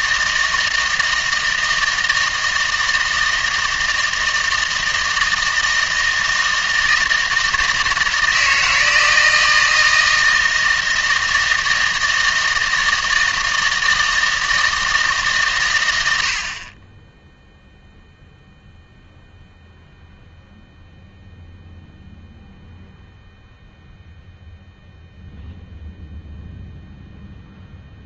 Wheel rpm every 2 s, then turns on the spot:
160, 160, 160, 160, 160, 160, 160, 160, 30, 0, 0, 0, 0, 0.
none